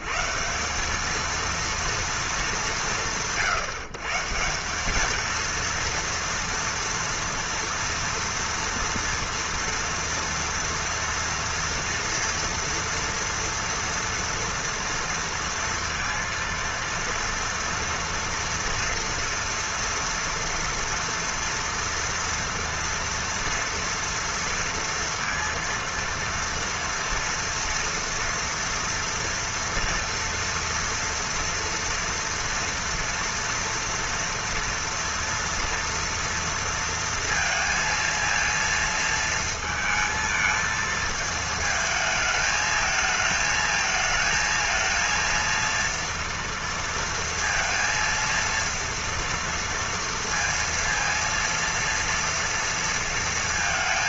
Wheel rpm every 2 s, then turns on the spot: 180, 190, 160, 230, 240, 230, 240, 230, 230, 230, 230, 230, 230, 230, 230, 230, 230, 230, 230, 230, 220, 220, 220, 230, 230, 230, 230.
none